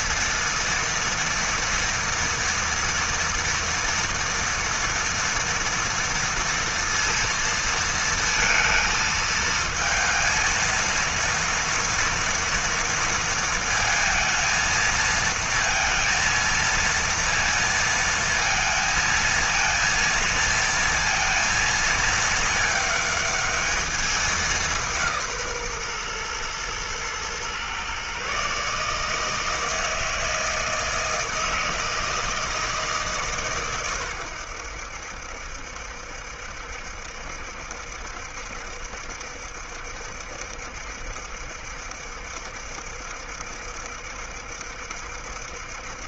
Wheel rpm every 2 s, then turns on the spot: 230, 230, 230, 230, 230, 230, 230, 230, 230, 230, 230, 220, 170, 120, 150, 160, 150, 80, 70, 70, 70, 70, 70.
none